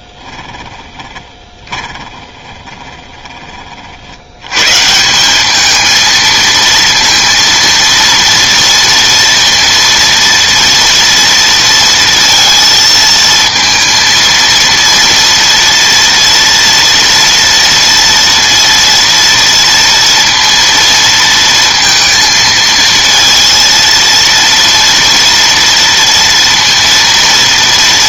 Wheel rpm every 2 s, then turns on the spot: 20, 20, 110, 220, 230, 230, 230, 230, 230, 230, 230, 230, 230, 230.
0-4